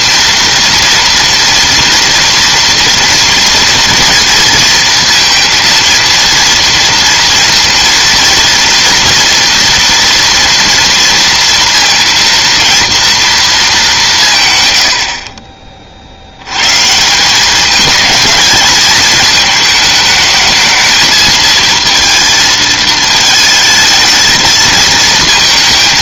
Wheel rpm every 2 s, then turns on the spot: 230, 230, 230, 230, 240, 230, 230, 40, 170, 220, 220, 220, 220.
none